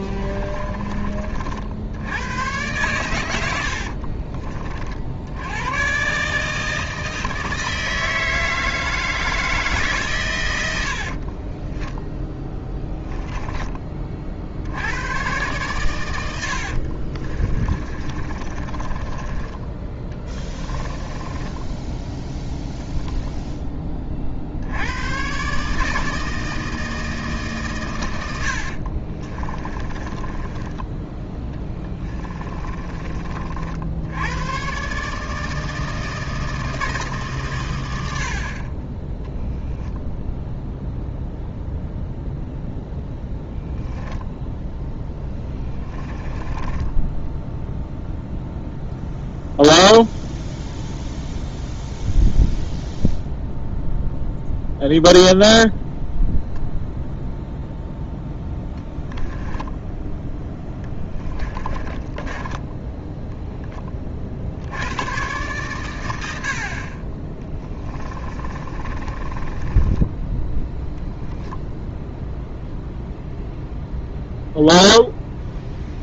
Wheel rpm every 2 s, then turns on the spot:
30, 120, 50, 160, 160, 80, 10, 70, 50, 20, 20, 0, 90, 160, 50, 10, 30, 130, 160, 30, 0, 0, 10, 10, 0, 0, 0, 0, 0, 0, 10, 10, 90, 40, 30, 0, 0, 0.
0-2 12-14 16-22 28-30 32-34 44-48 60-64 68-70